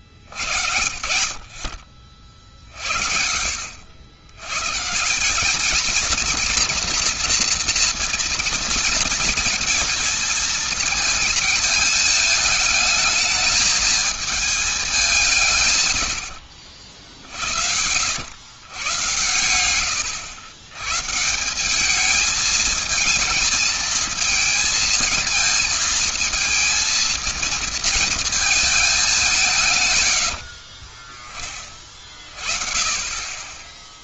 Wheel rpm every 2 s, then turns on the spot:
80, 40, 120, 240, 230, 220, 210, 220, 70, 100, 110, 220, 220, 220, 220, 60, 30.
16-18 30-32